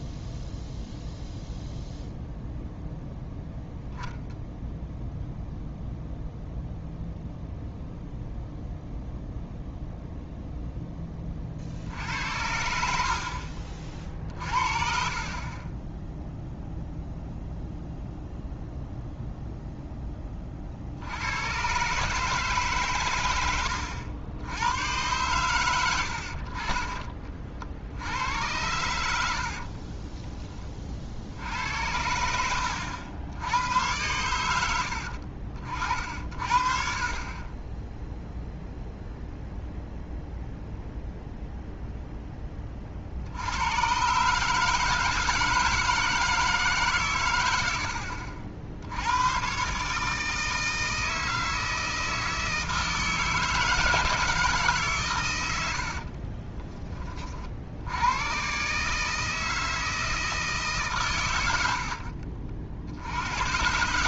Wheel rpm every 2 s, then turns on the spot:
0, 0, 0, 0, 0, 0, 70, 50, 0, 0, 50, 140, 90, 40, 90, 30, 80, 80, 40, 0, 0, 30, 150, 150, 70, 160, 160, 150, 20, 130, 150, 60.
14-16 32-34